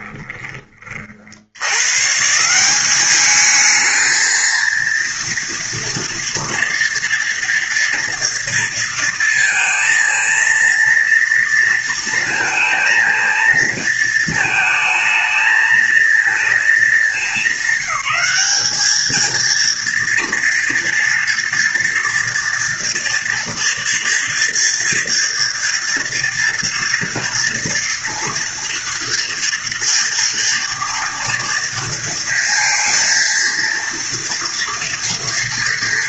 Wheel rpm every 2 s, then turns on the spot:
30, 190, 230, 230, 230, 230, 230, 220, 220, 220, 230, 230, 240, 230, 230, 230, 230, 230.
none